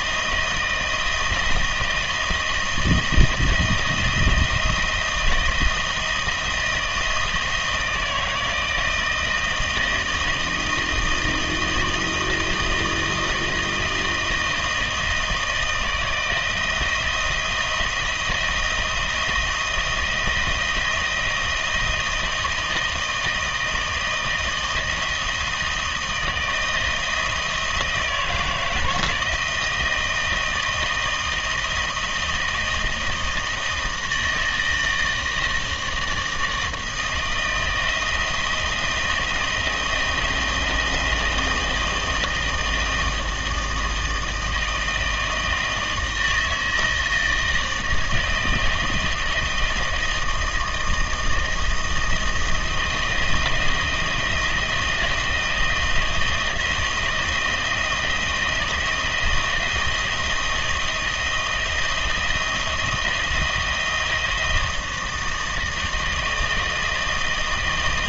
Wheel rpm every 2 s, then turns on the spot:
170, 160, 170, 160, 160, 160, 160, 160, 160, 170, 170, 160, 160, 160, 160, 160, 160, 160, 160, 160, 160, 160, 160, 160, 160, 160, 170, 160, 160, 170, 160, 170, 160, 160.
none